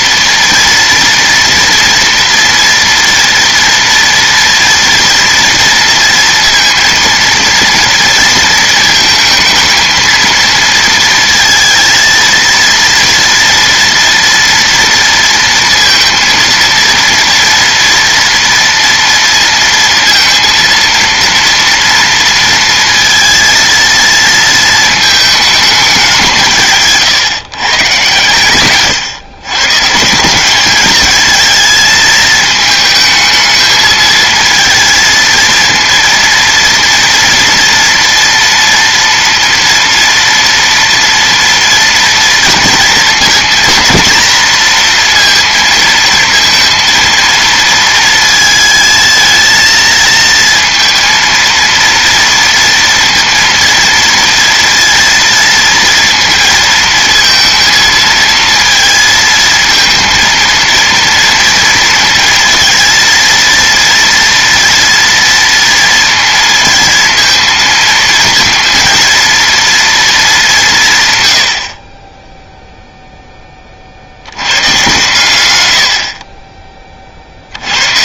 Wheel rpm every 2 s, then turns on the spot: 240, 230, 230, 230, 230, 230, 230, 230, 230, 230, 230, 230, 220, 140, 120, 210, 220, 230, 230, 230, 230, 230, 230, 230, 220, 230, 230, 230, 230, 220, 230, 230, 230, 230, 230, 160, 0, 120, 30.
none